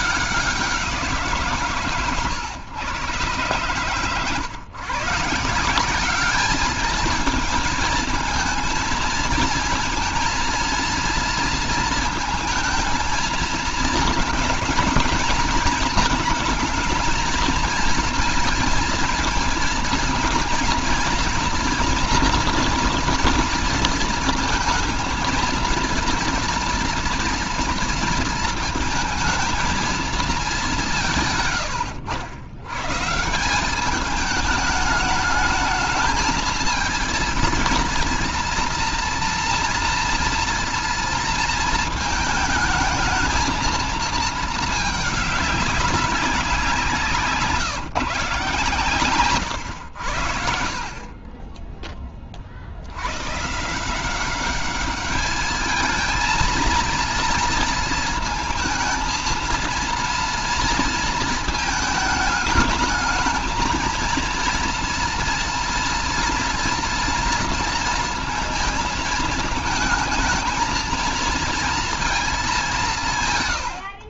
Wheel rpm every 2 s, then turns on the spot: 170, 120, 140, 210, 220, 230, 220, 230, 220, 230, 230, 230, 220, 230, 220, 170, 150, 210, 230, 240, 230, 220, 210, 170, 130, 40, 80, 200, 230, 230, 230, 220, 230, 230, 220, 220, 170.
none